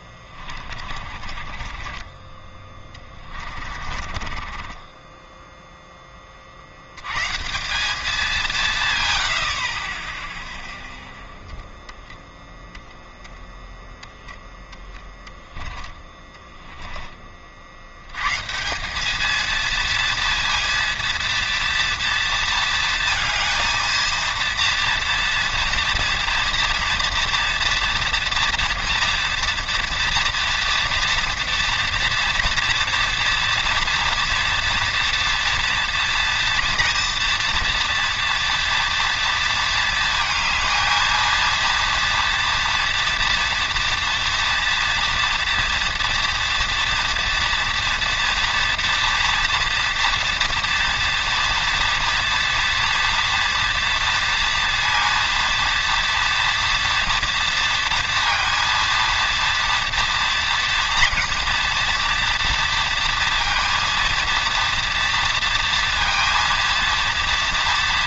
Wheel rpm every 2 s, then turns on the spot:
30, 20, 30, 40, 170, 0, 0, 0, 10, 160, 230, 230, 230, 240, 240, 230, 240, 230, 230, 240, 220, 230, 230, 230, 240, 230, 230, 230, 230, 230, 230, 230, 230, 230.
0-2 4-6 16-18